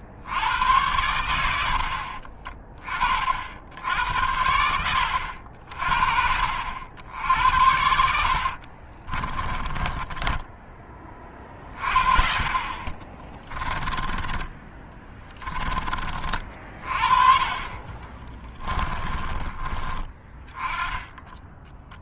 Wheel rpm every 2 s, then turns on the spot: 80, 40, 80, 50, 70, 10, 30, 20, 40, 20, 20.
8-10 14-16 18-20